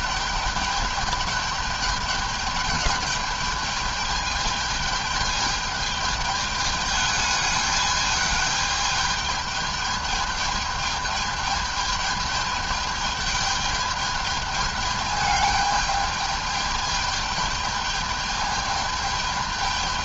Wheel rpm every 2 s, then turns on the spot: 210, 210, 210, 210, 210, 210, 210, 210, 210, 210.
none